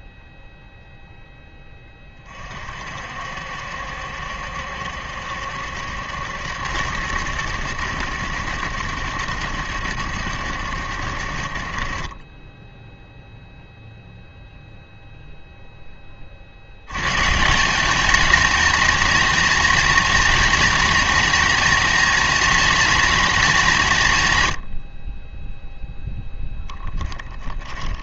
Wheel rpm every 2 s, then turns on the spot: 0, 50, 70, 80, 80, 70, 10, 0, 90, 230, 240, 230, 90, 10.
26-28